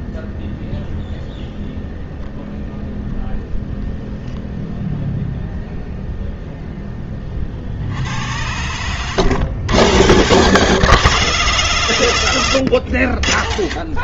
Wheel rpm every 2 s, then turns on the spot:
0, 0, 0, 30, 100, 120, 70.
8-10